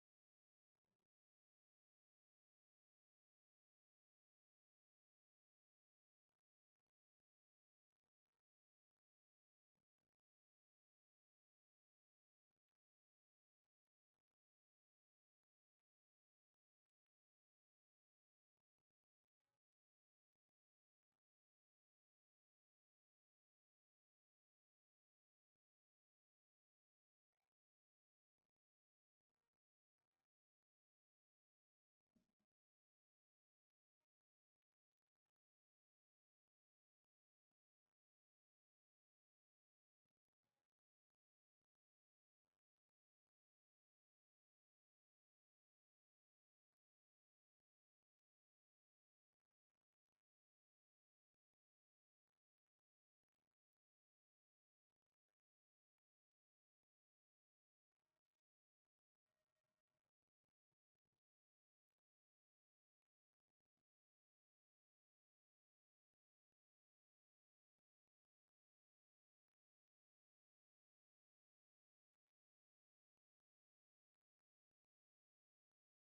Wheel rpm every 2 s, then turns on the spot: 0, 0, 0, 0, 0, 0, 0, 0, 0, 0, 0, 0, 0, 0, 0, 0, 0, 0, 0, 0, 0, 0, 0, 0, 0, 0, 0, 0, 0, 0, 0, 0, 0, 0, 0, 0, 0, 0.
none